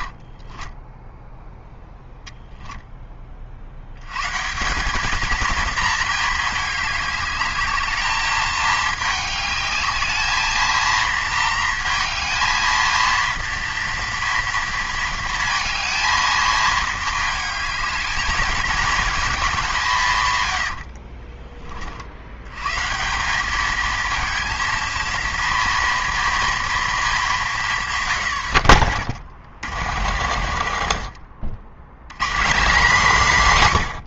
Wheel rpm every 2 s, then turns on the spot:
30, 0, 140, 220, 210, 220, 220, 230, 220, 220, 120, 100, 220, 230, 110, 90, 180.
0-2 20-22 28-32